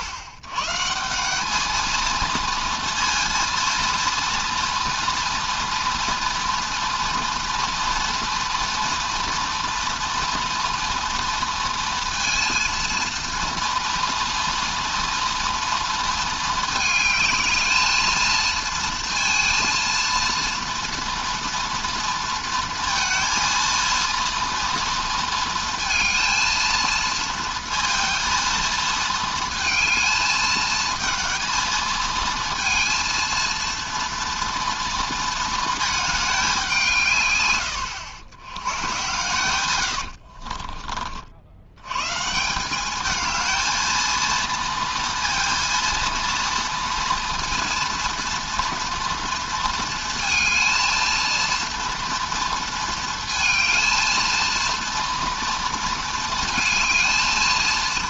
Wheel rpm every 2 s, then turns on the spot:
130, 230, 230, 230, 230, 230, 230, 230, 220, 230, 230, 230, 230, 230, 230, 220, 230, 230, 190, 110, 50, 180, 230, 230, 230, 230, 230, 230, 220.
40-42